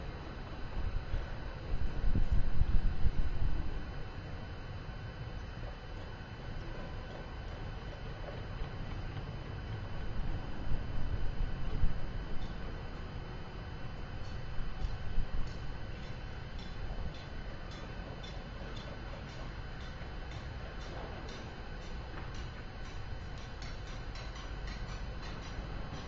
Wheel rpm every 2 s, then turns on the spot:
0, 0, 0, 0, 0, 0, 0, 0, 0, 0, 0, 0, 0.
none